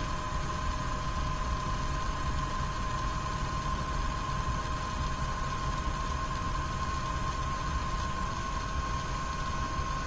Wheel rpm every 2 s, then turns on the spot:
0, 0, 0, 0, 0.
none